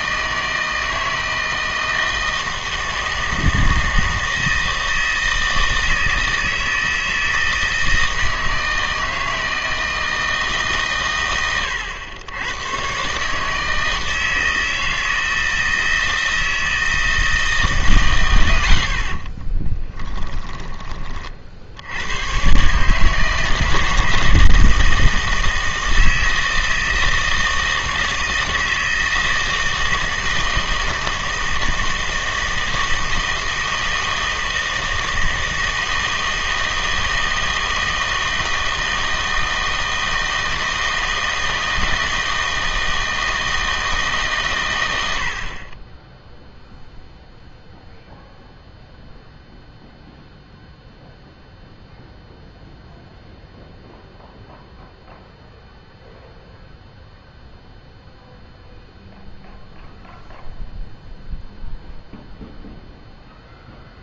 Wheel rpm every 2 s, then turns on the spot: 160, 160, 160, 160, 160, 140, 120, 160, 160, 80, 20, 140, 160, 160, 160, 160, 160, 160, 160, 160, 160, 160, 110, 0, 0, 0, 0, 0, 0, 0, 0, 0.
20-22